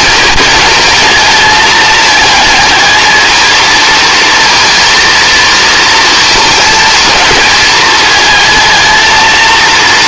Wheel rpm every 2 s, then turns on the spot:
220, 220, 230, 220, 220.
none